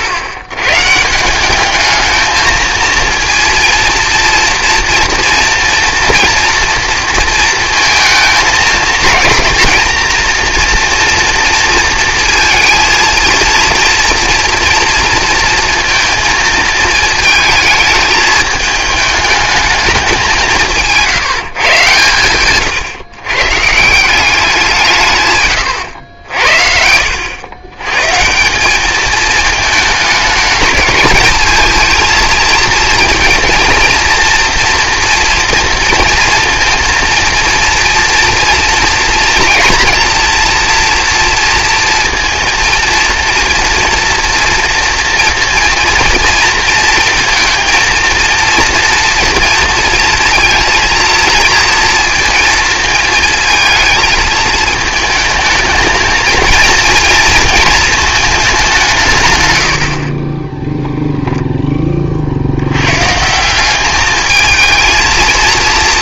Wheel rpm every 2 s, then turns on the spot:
110, 220, 230, 230, 220, 240, 230, 230, 220, 210, 170, 130, 180, 70, 190, 210, 230, 230, 230, 230, 230, 230, 230, 230, 230, 230, 230, 220, 230, 190, 10, 90, 220.
26-28 60-62